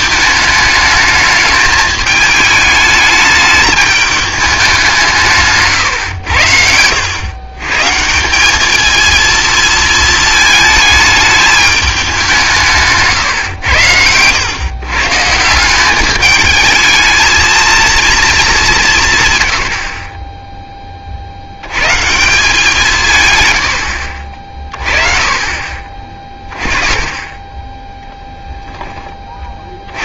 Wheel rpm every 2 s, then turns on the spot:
210, 220, 200, 90, 200, 220, 170, 110, 210, 210, 10, 170, 40, 20, 10.
6-8